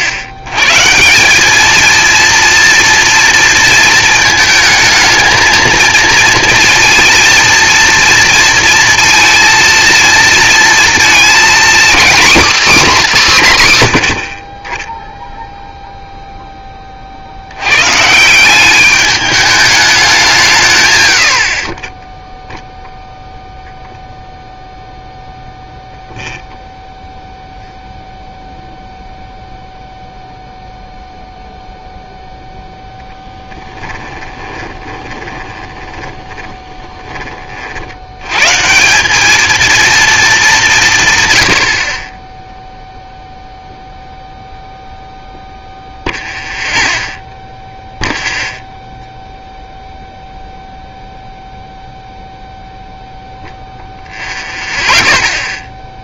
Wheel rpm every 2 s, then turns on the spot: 130, 230, 220, 230, 230, 230, 260, 40, 20, 190, 140, 0, 0, 0, 0, 0, 10, 20, 10, 150, 200, 0, 0, 0, 0, 0, 0, 0.
34-38